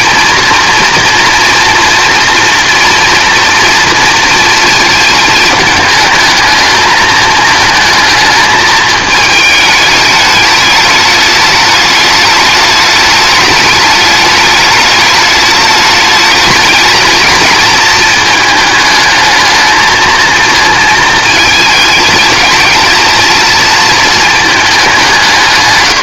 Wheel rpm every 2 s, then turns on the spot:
230, 230, 220, 220, 220, 210, 210, 210, 220, 210, 220, 220, 210.
none